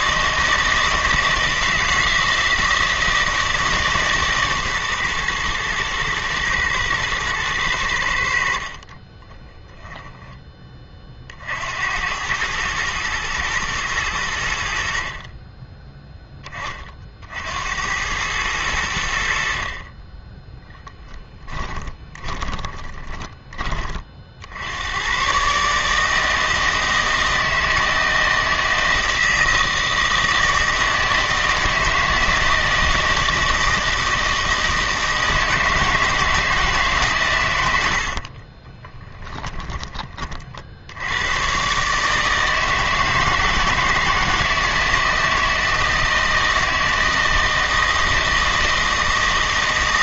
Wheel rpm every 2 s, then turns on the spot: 160, 160, 130, 110, 50, 20, 110, 80, 20, 100, 10, 20, 80, 160, 160, 160, 160, 160, 160, 30, 50, 160, 160, 160, 160.
20-24 38-40